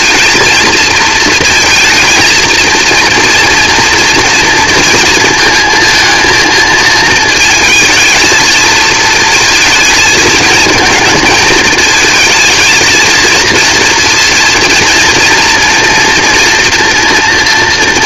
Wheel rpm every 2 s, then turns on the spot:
230, 230, 230, 230, 220, 220, 230, 230, 230.
none